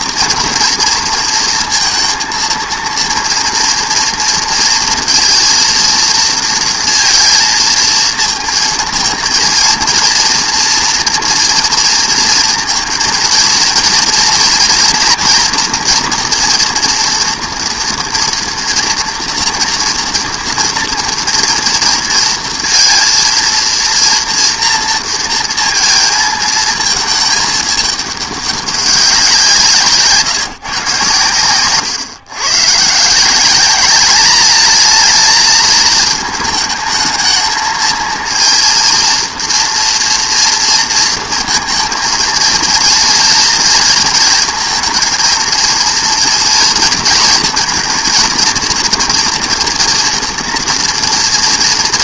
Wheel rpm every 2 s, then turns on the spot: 230, 230, 230, 230, 220, 230, 230, 230, 230, 230, 230, 230, 230, 220, 200, 140, 130, 210, 220, 230, 240, 230, 230, 230, 230, 230.
none